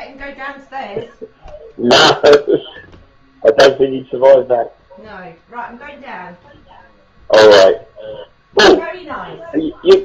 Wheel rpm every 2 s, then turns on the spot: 0, 0, 0, 0, 0.
none